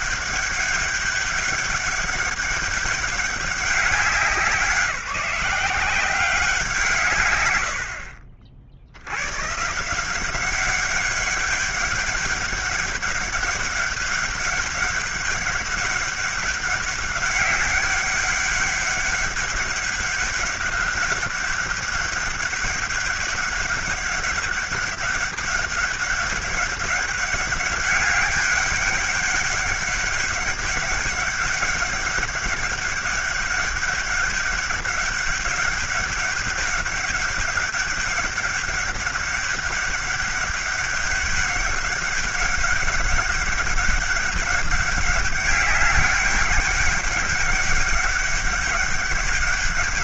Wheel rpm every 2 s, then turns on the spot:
200, 200, 170, 180, 70, 190, 200, 200, 200, 190, 200, 200, 200, 200, 200, 200, 200, 200, 200, 200, 200, 200, 200, 200, 200.
none